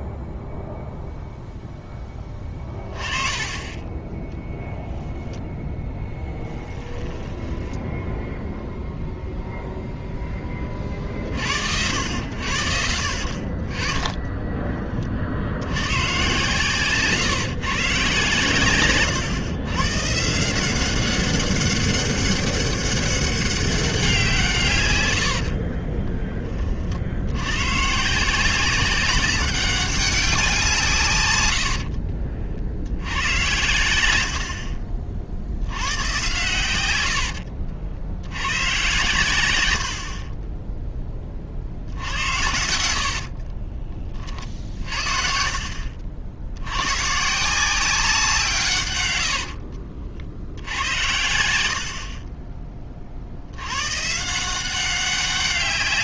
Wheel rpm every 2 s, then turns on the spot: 0, 20, 0, 20, 0, 30, 80, 20, 140, 130, 170, 200, 150, 40, 180, 170, 60, 50, 120, 110, 10, 90, 40, 100, 140, 80, 20, 180.
2-4 6-8 16-18 34-36 42-44